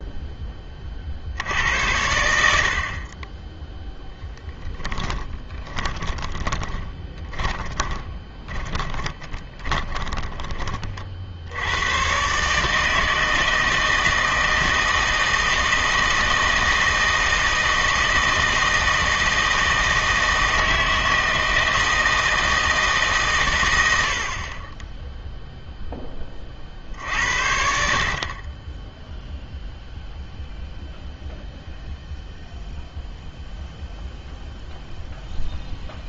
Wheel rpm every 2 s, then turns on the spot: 30, 60, 10, 20, 20, 30, 150, 160, 160, 160, 160, 160, 30, 50, 20, 0, 0, 0.
4-10